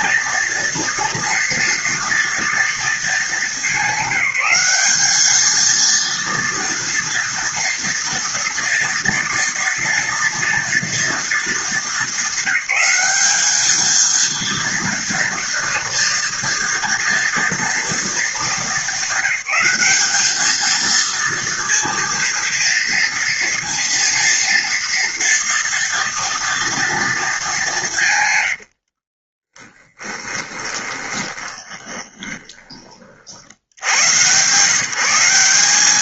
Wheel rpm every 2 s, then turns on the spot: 230, 230, 190, 230, 230, 230, 200, 230, 230, 220, 210, 230, 230, 240, 140, 20, 20, 110.
30-34